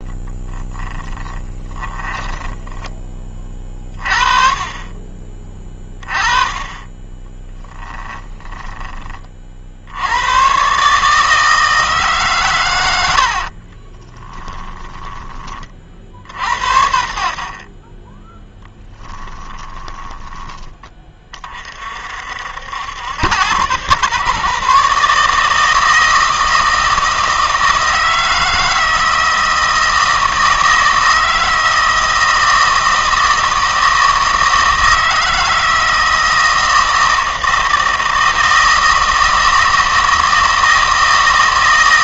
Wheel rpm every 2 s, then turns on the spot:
10, 20, 30, 20, 20, 140, 120, 10, 80, 20, 20, 80, 140, 160, 160, 160, 160, 160, 160, 160, 160.
0-4 14-16 18-20